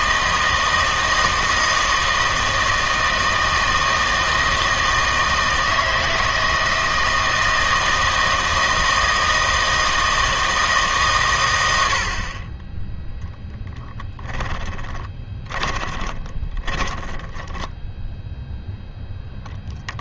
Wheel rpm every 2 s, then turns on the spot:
160, 160, 160, 160, 160, 160, 20, 10, 20, 0.
14-18